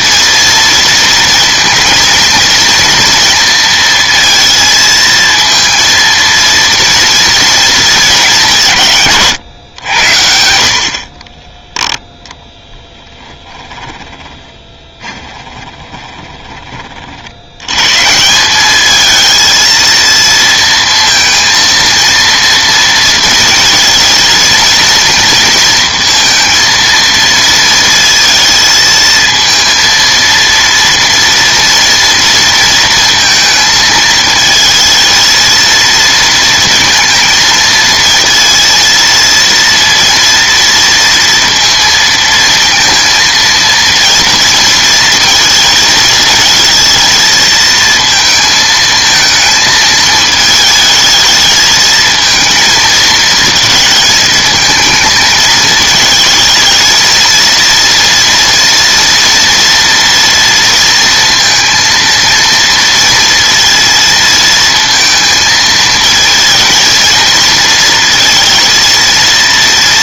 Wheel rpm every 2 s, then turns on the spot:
230, 230, 230, 230, 160, 60, 10, 10, 30, 210, 230, 230, 230, 230, 220, 230, 230, 220, 230, 230, 230, 230, 230, 220, 220, 220, 220, 220, 220, 230, 230, 230, 230, 230, 230.
12-16